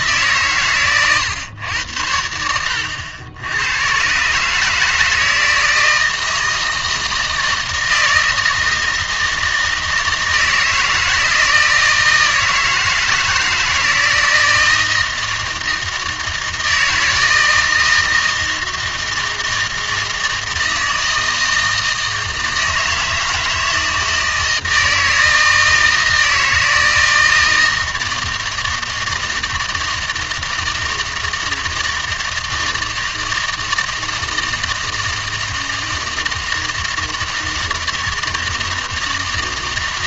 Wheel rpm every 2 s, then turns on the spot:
120, 90, 160, 160, 160, 160, 160, 160, 160, 160, 160, 160, 160, 160, 160, 160, 160, 160, 160, 160.
2-4